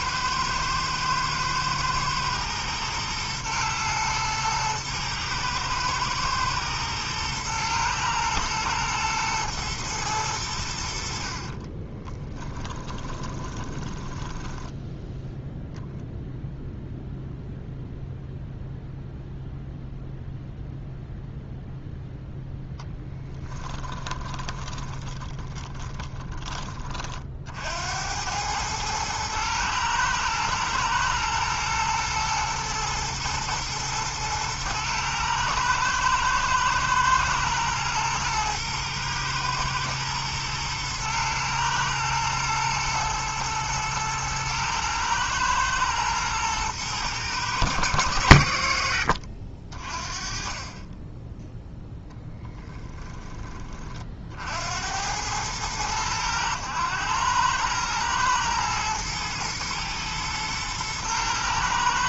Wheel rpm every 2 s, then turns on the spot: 110, 110, 110, 110, 110, 80, 20, 10, 0, 0, 0, 10, 20, 30, 110, 110, 120, 110, 110, 110, 110, 110, 110, 110, 80, 20, 20, 80, 100, 110, 110.
12-14 22-26 52-54